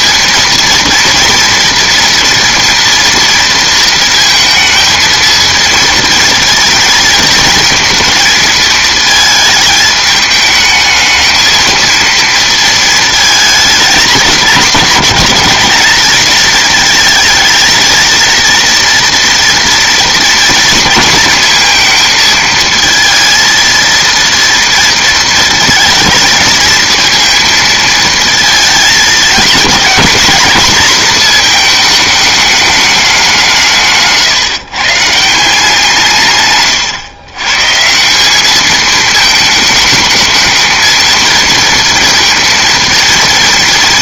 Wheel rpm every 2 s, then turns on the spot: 230, 230, 220, 230, 220, 220, 220, 220, 220, 230, 230, 230, 230, 220, 220, 220, 210, 140, 130, 210, 220, 230.
none